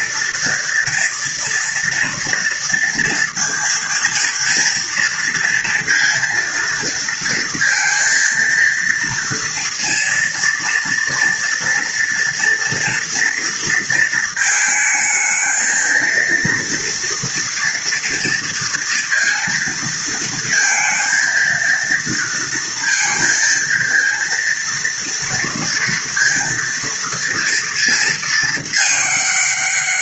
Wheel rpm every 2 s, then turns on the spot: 230, 230, 230, 230, 230, 230, 230, 220, 230, 230, 230, 230, 230, 230, 220.
none